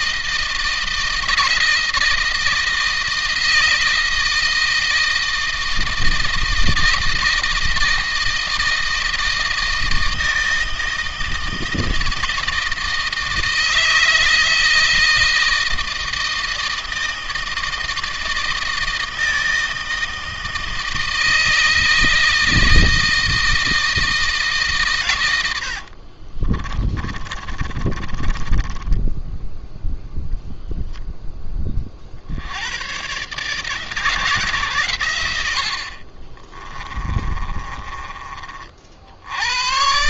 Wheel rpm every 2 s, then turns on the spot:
160, 160, 160, 160, 160, 160, 160, 160, 160, 160, 160, 160, 140, 30, 20, 0, 100, 130, 30, 50.
26-30 36-38